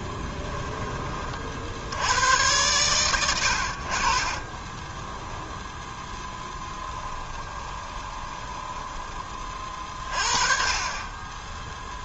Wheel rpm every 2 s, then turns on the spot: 10, 110, 20, 10, 10, 30.
4-10